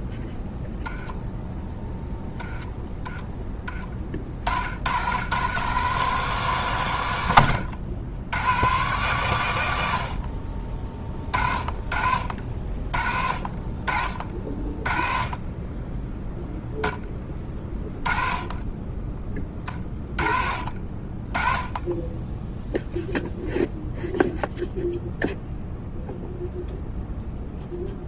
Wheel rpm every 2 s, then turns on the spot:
0, 10, 70, 140, 120, 30, 50, 40, 0, 20, 40, 0, 0, 0.
none